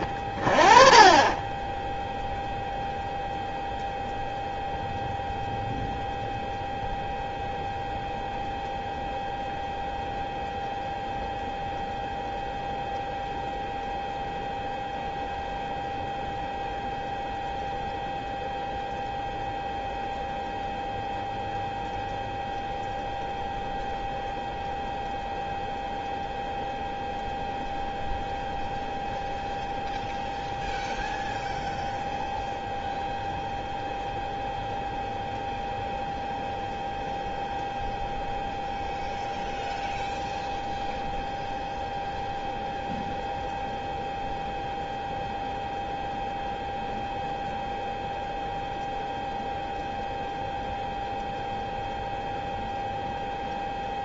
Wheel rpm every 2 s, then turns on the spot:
30, 0, 0, 0, 0, 0, 0, 0, 0, 0, 0, 0, 0, 0, 0, 0, 0, 0, 0, 0, 0, 0, 0, 0, 0, 0, 0.
none